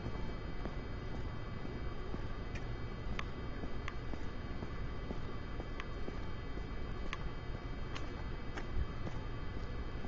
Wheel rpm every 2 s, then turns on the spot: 0, 0, 0, 0, 0.
none